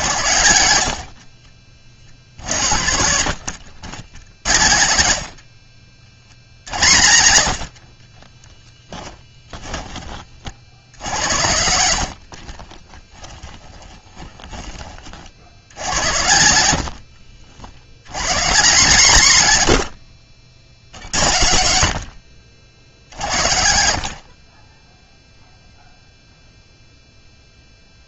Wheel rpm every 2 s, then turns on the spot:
80, 70, 90, 80, 10, 60, 30, 20, 80, 140, 70, 60, 10, 0.
8-10 12-14 16-18